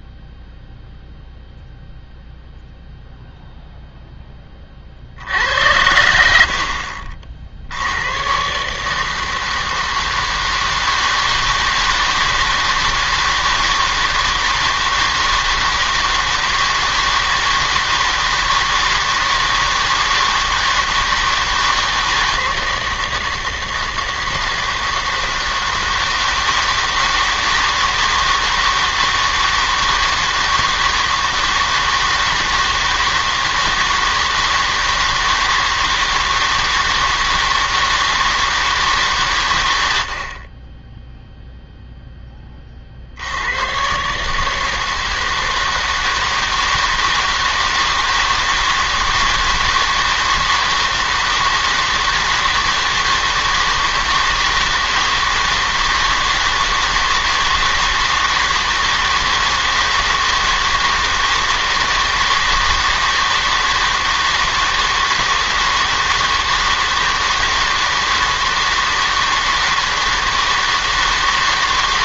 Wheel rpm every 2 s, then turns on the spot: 0, 0, 20, 60, 130, 160, 160, 160, 160, 160, 160, 160, 160, 160, 160, 160, 160, 160, 160, 160, 30, 30, 160, 160, 160, 160, 160, 160, 160, 160, 160, 160, 160, 160, 160, 160.
none